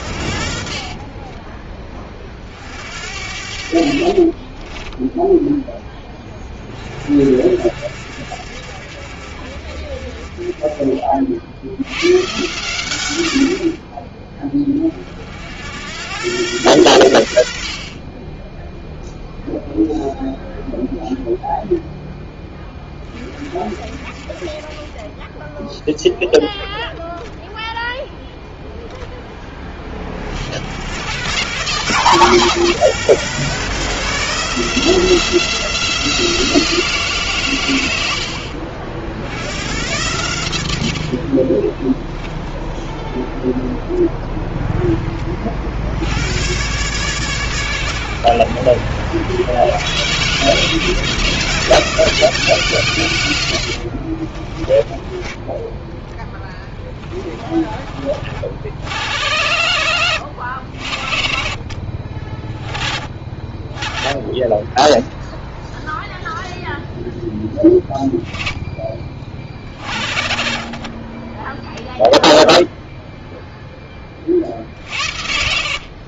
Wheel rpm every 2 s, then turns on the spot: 50, 50, 30, 20, 50, 30, 110, 20, 110, 10, 0, 10, 30, 0, 0, 80, 160, 160, 170, 60, 90, 0, 0, 110, 90, 150, 170, 20, 10, 40, 50, 10, 10, 0, 10, 30, 0, 50.
4-6 54-56